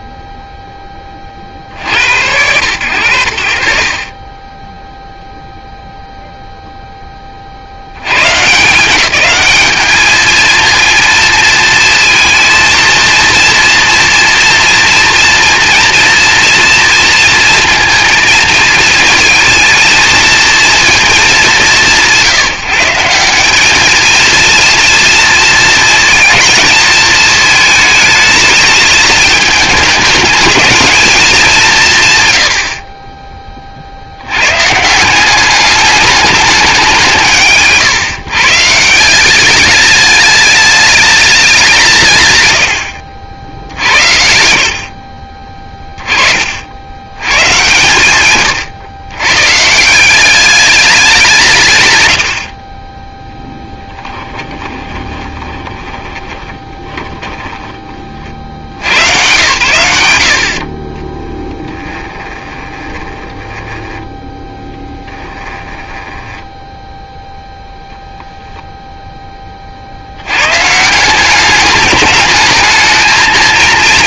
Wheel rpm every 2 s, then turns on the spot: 0, 60, 40, 0, 130, 220, 230, 230, 230, 220, 220, 160, 230, 220, 220, 220, 110, 110, 200, 140, 210, 110, 60, 50, 130, 200, 40, 20, 20, 100, 40, 20, 10, 10, 0, 140, 220.
52-58 62-66